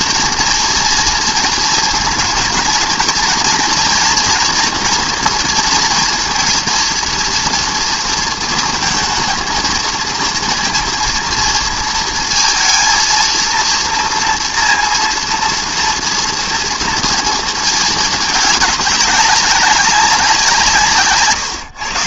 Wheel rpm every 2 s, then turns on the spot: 230, 230, 240, 230, 220, 230, 230, 230, 230, 210, 160.
none